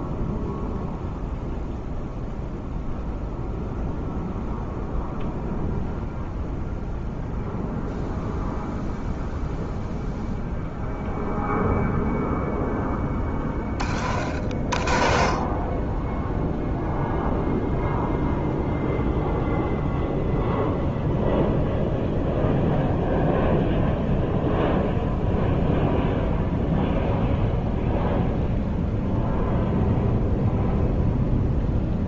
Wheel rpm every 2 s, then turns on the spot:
0, 0, 0, 0, 0, 0, 10, 40, 0, 0, 0, 0, 0, 0, 0, 0.
12-14